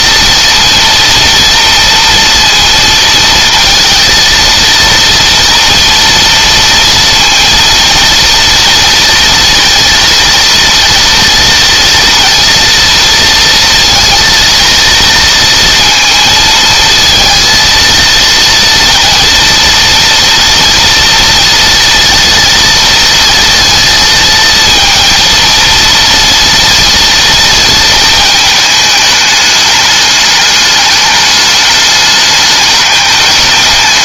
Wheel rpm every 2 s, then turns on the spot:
230, 230, 230, 230, 230, 230, 230, 230, 230, 230, 230, 230, 230, 230, 220, 210, 210.
none